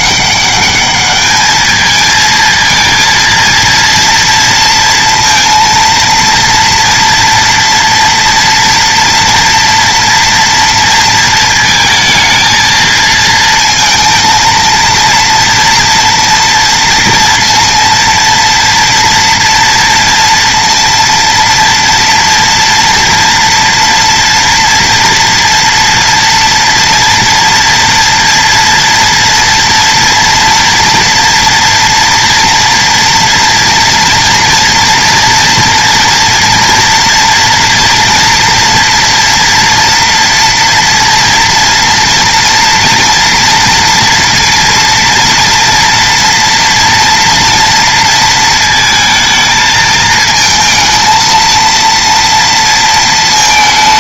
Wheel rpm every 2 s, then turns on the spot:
210, 230, 230, 240, 230, 230, 220, 230, 230, 230, 230, 240, 230, 230, 230, 240, 230, 230, 240, 230, 240, 240, 230, 230, 220, 220, 230.
none